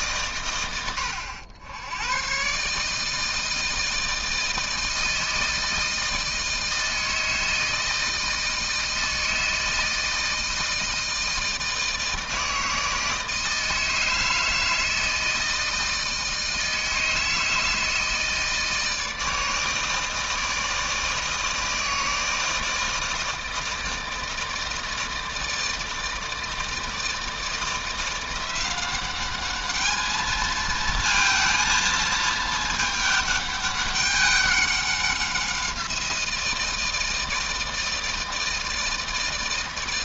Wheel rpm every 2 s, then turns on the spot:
90, 150, 160, 160, 160, 160, 160, 160, 160, 160, 160, 160, 160, 160, 190, 230, 210, 190, 160, 160.
none